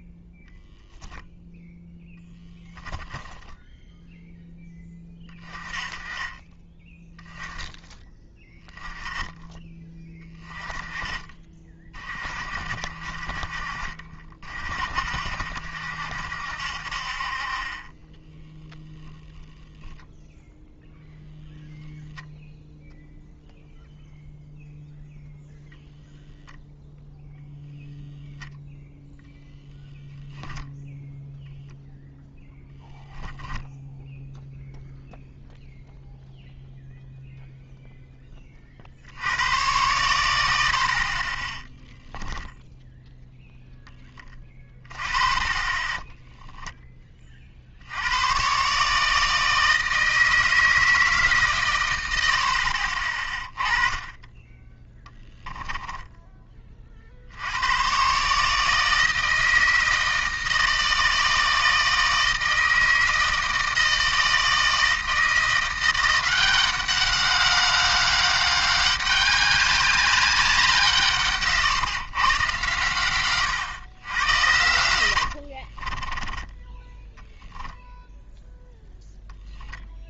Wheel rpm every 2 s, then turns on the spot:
10, 10, 10, 20, 10, 20, 50, 50, 60, 10, 0, 0, 0, 0, 0, 0, 10, 0, 0, 50, 60, 0, 20, 10, 140, 160, 50, 10, 40, 160, 160, 160, 160, 190, 200, 170, 120, 80, 10, 0.
2-4 32-34 74-76